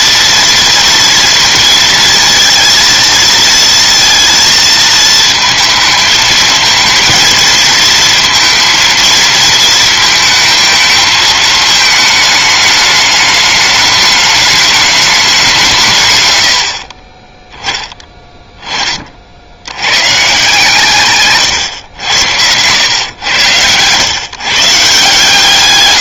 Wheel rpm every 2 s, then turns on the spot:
230, 220, 230, 220, 230, 220, 210, 210, 50, 20, 150, 100, 140.
none